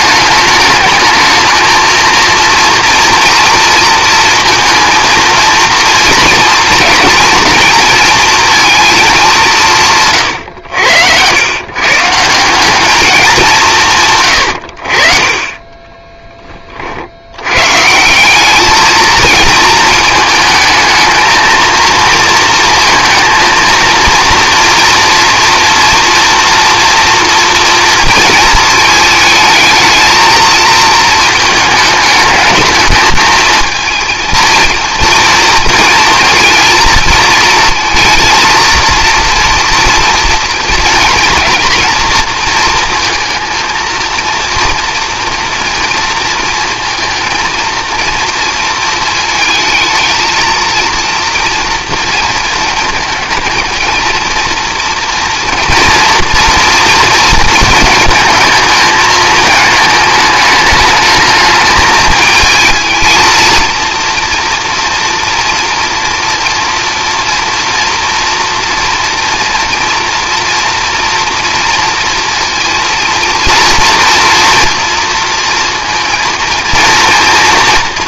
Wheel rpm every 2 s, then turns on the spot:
220, 230, 230, 230, 230, 100, 180, 90, 30, 220, 220, 230, 230, 240, 220, 220, 220, 230, 230, 230, 230, 230, 230, 230, 230, 230, 220, 240, 230, 220, 210, 220, 230, 230, 230, 230, 230, 230, 230.
10-12